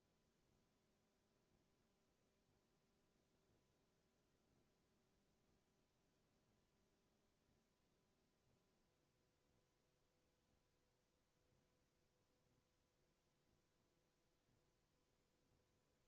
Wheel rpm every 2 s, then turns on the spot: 0, 0, 0, 0, 0, 0, 0, 0.
none